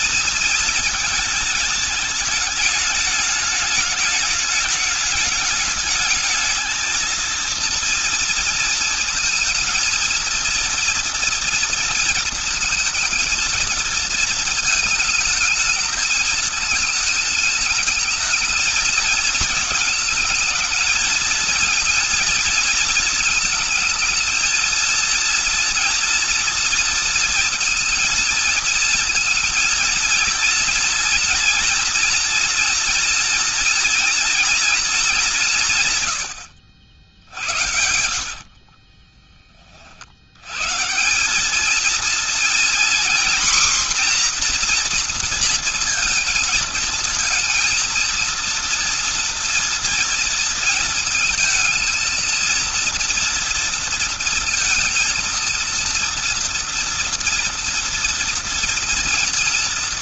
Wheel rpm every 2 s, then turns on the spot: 220, 210, 210, 220, 230, 230, 230, 220, 220, 220, 230, 230, 230, 230, 230, 230, 230, 220, 70, 40, 150, 240, 240, 220, 230, 230, 230, 230, 230, 230.
36-40